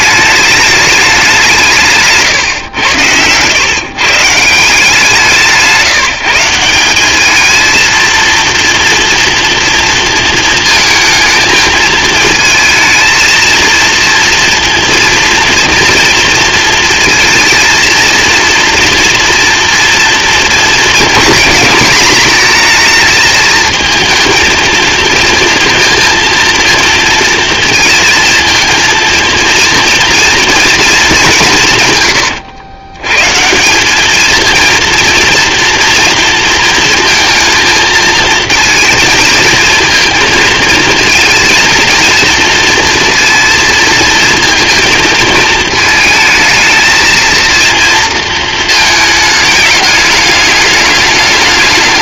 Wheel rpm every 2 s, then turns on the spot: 210, 110, 160, 180, 230, 220, 220, 230, 230, 230, 230, 220, 230, 230, 230, 230, 110, 230, 230, 230, 220, 230, 220, 220, 220, 210.
none